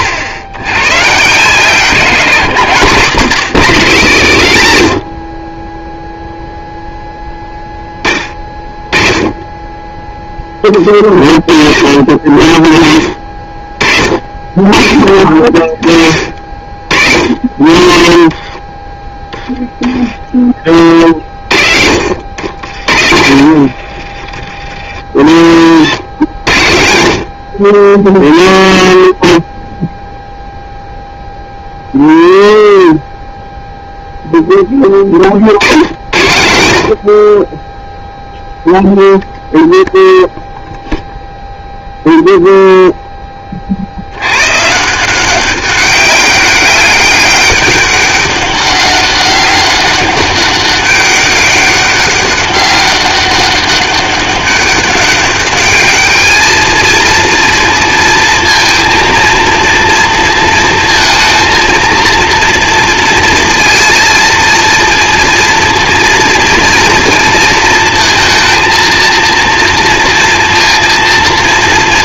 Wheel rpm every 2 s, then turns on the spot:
110, 170, 120, 0, 20, 20, 30, 40, 50, 10, 40, 80, 60, 80, 0, 0, 0, 10, 70, 0, 0, 0, 150, 200, 190, 200, 200, 200, 220, 230, 230, 230, 230, 230, 230, 230.
22-24